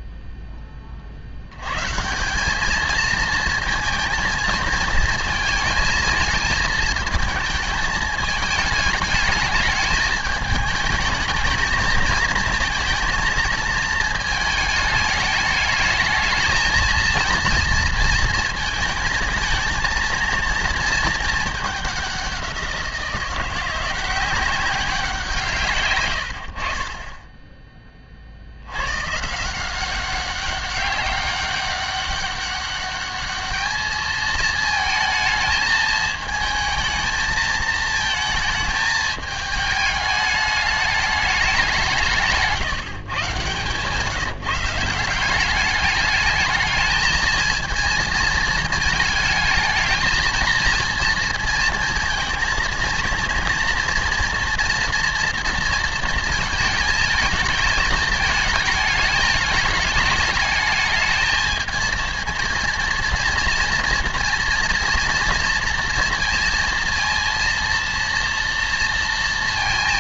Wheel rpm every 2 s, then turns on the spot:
10, 200, 220, 220, 210, 210, 230, 220, 220, 230, 230, 180, 190, 80, 80, 200, 200, 220, 220, 220, 210, 150, 160, 220, 230, 220, 230, 230, 220, 220, 210, 230, 230, 230, 230.
42-44